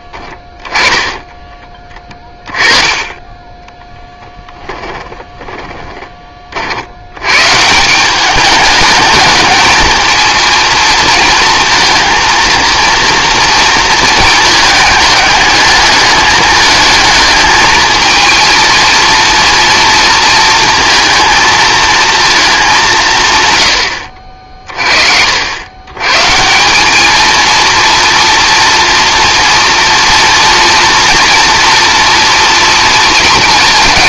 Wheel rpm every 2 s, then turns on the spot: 10, 20, 10, 50, 200, 230, 230, 220, 210, 230, 230, 200, 40, 180, 230, 230, 240.
0-2 4-6